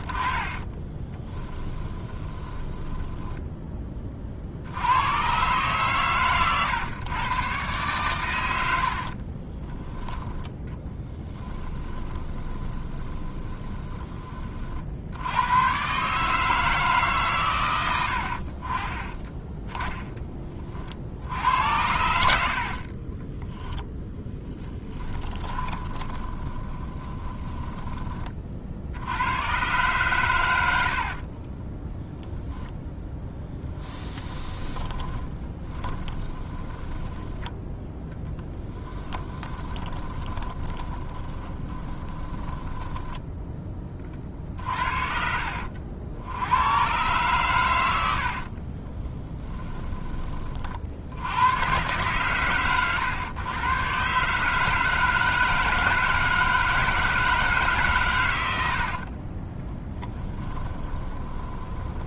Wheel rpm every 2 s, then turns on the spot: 20, 20, 80, 110, 80, 10, 20, 50, 150, 50, 40, 50, 10, 20, 60, 90, 0, 20, 10, 10, 20, 10, 40, 100, 30, 40, 130, 150, 160, 80, 20.
0-4 10-14 22-28 30-32 34-44 48-50 58-62